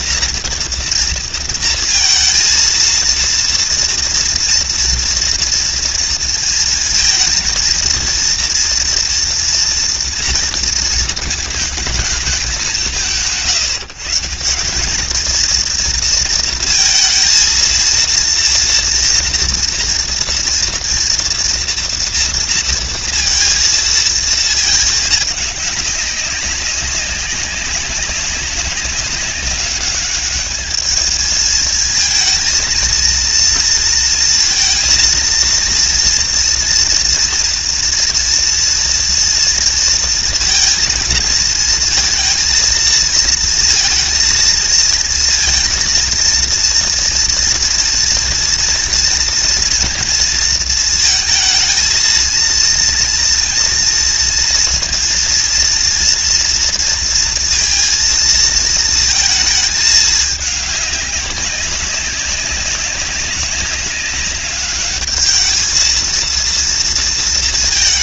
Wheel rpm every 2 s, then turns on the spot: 230, 230, 230, 230, 240, 220, 180, 210, 230, 230, 230, 230, 210, 190, 190, 220, 230, 230, 230, 230, 220, 230, 230, 230, 230, 220, 230, 230, 230, 220, 200, 190, 210, 230.
none